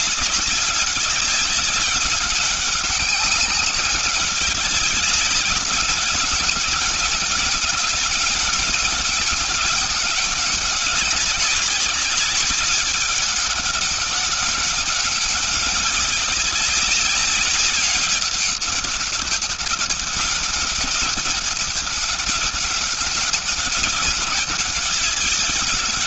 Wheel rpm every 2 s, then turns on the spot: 200, 190, 190, 200, 190, 190, 200, 200, 200, 200, 190, 190, 190.
none